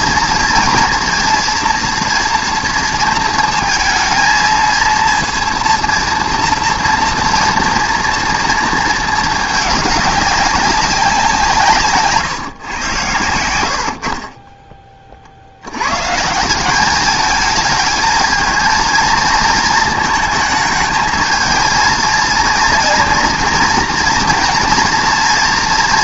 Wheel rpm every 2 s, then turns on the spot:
230, 230, 230, 230, 230, 200, 130, 20, 180, 220, 220, 230, 230.
none